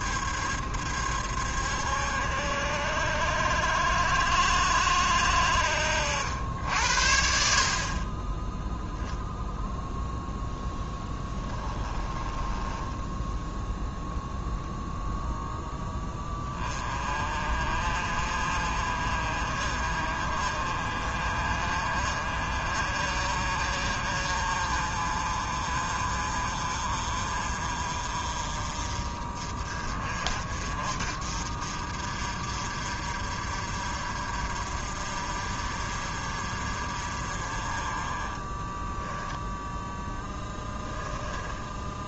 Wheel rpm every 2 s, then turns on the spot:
70, 70, 70, 60, 0, 10, 10, 0, 30, 40, 40, 40, 40, 40, 40, 50, 50, 50, 50, 10, 10.
10-14 38-42